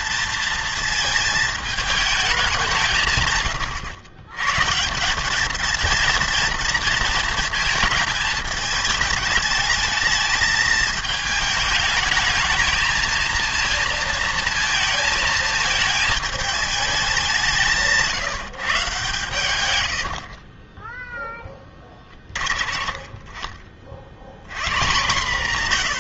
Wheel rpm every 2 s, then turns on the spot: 230, 170, 140, 230, 220, 220, 220, 230, 220, 160, 20, 30, 120.
20-22